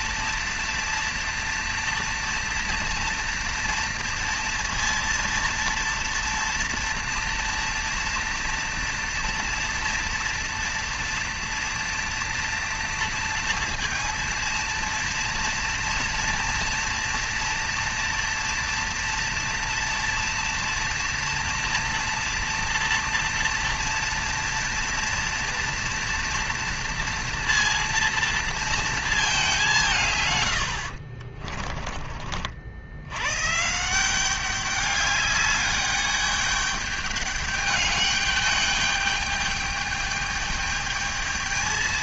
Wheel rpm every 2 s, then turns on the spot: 230, 230, 230, 230, 230, 230, 230, 230, 240, 230, 230, 230, 230, 230, 230, 140, 40, 180, 210, 210, 210.
none